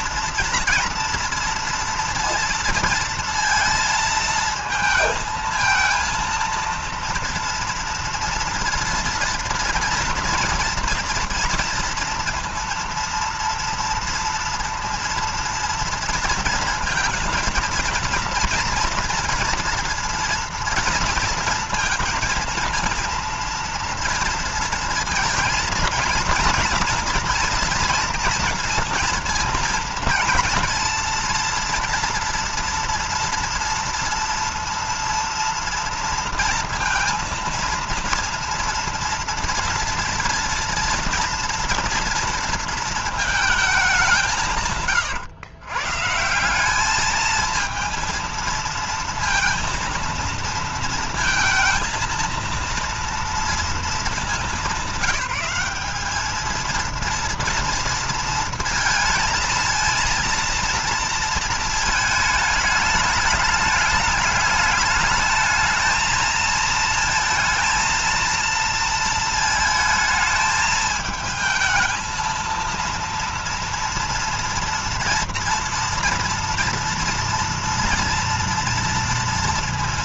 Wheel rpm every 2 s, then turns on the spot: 230, 230, 220, 230, 230, 230, 230, 230, 230, 240, 230, 230, 230, 230, 230, 230, 230, 230, 230, 230, 230, 230, 140, 190, 230, 230, 230, 210, 230, 230, 230, 210, 220, 220, 230, 220, 230, 230, 230, 230.
none